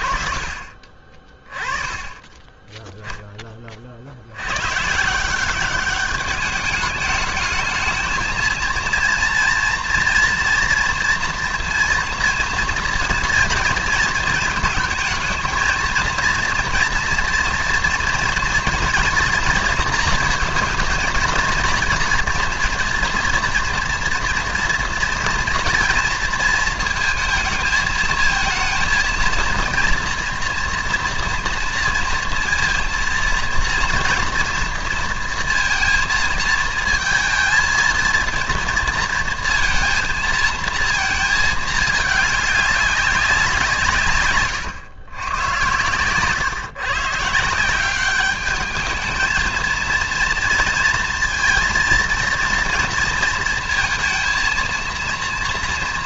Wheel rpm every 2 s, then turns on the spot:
40, 10, 110, 210, 230, 240, 230, 220, 230, 230, 230, 230, 230, 230, 230, 230, 230, 230, 220, 230, 230, 200, 110, 140, 210, 230, 230, 230.
none